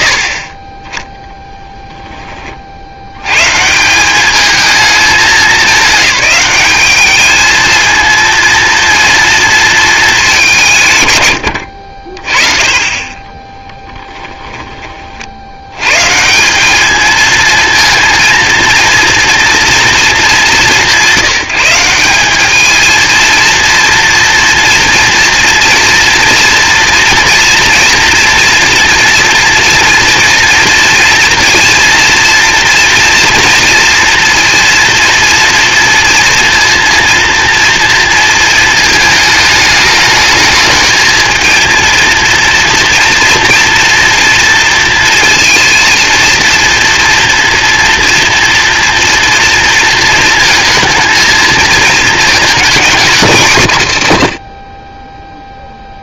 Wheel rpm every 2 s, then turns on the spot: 30, 110, 210, 220, 230, 100, 20, 70, 230, 230, 180, 230, 230, 230, 230, 230, 230, 230, 230, 220, 230, 230, 230, 240, 240, 220, 180, 0.
12-14